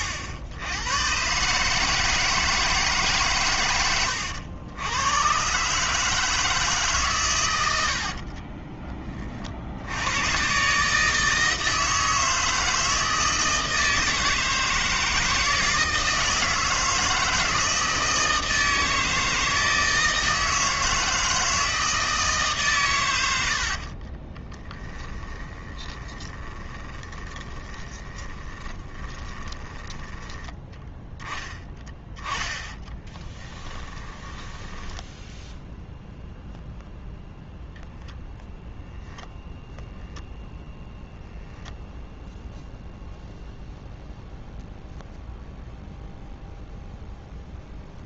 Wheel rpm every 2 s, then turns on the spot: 90, 160, 90, 150, 20, 140, 160, 160, 160, 160, 160, 130, 20, 20, 20, 10, 10, 10, 0, 0, 0, 0, 0, 0.
8-10 24-30 32-36